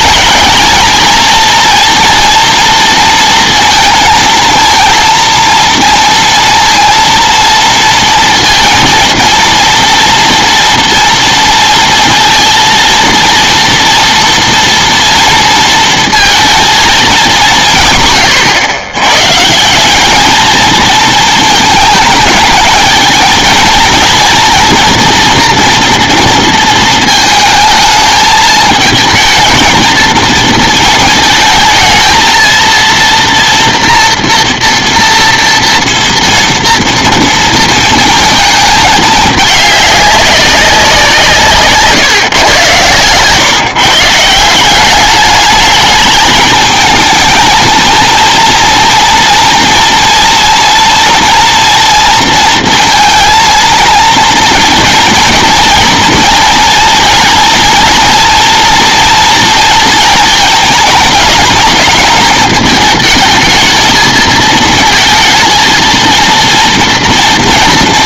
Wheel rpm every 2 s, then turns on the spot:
220, 230, 230, 230, 230, 230, 230, 230, 230, 120, 220, 220, 230, 230, 220, 220, 230, 230, 230, 220, 200, 120, 180, 220, 230, 240, 230, 230, 230, 230, 220, 220, 220, 230.
none